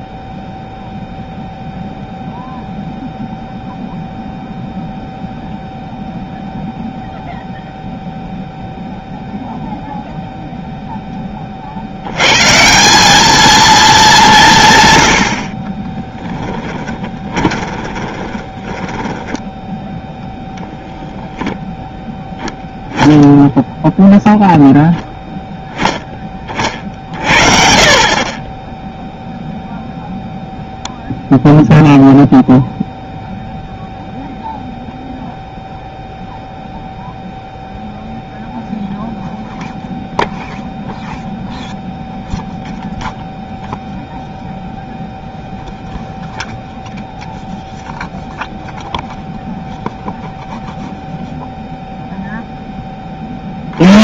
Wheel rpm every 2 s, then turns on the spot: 0, 0, 0, 0, 0, 0, 160, 150, 10, 10, 0, 0, 0, 30, 20, 0, 0, 0, 0, 0, 0, 0, 0, 0, 0, 0, 10.
16-20